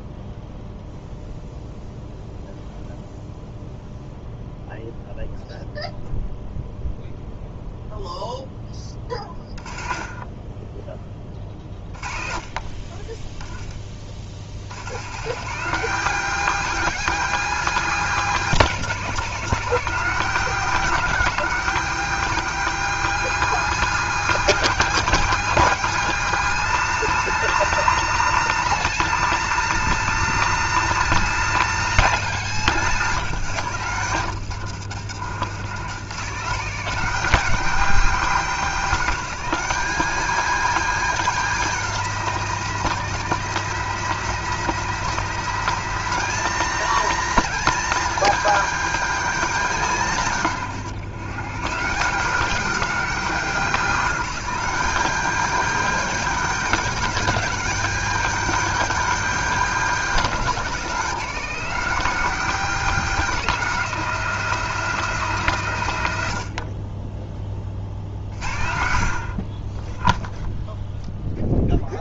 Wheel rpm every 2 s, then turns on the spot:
0, 0, 0, 0, 10, 10, 30, 100, 230, 210, 220, 230, 240, 230, 230, 230, 200, 120, 200, 220, 240, 230, 230, 230, 230, 130, 220, 220, 230, 230, 210, 230, 230, 50, 60, 0.
none